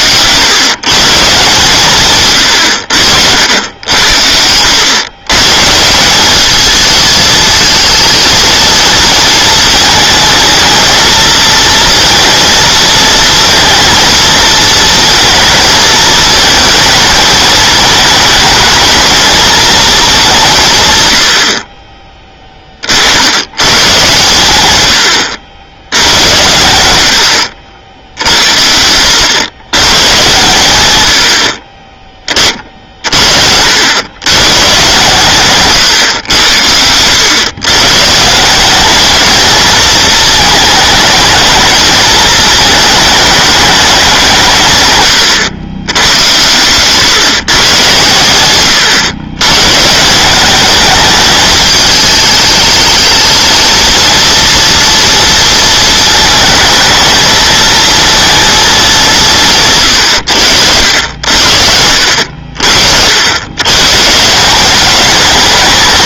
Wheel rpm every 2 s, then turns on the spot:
140, 90, 100, 210, 220, 220, 230, 230, 220, 220, 140, 30, 110, 100, 80, 120, 40, 130, 100, 190, 220, 220, 130, 110, 110, 200, 220, 230, 220, 220, 80, 80, 200.
none